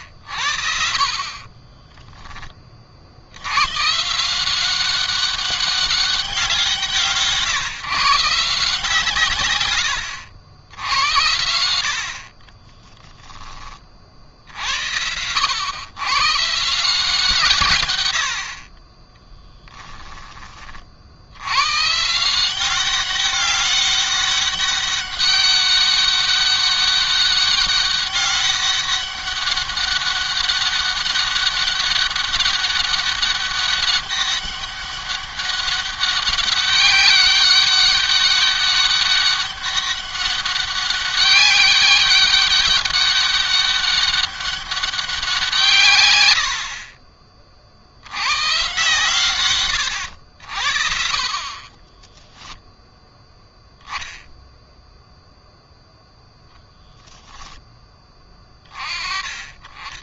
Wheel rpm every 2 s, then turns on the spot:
70, 20, 170, 180, 150, 90, 30, 60, 140, 70, 30, 170, 200, 200, 200, 200, 200, 200, 200, 200, 200, 200, 200, 70, 120, 80, 10, 0, 0, 20.
12-14 46-48 52-54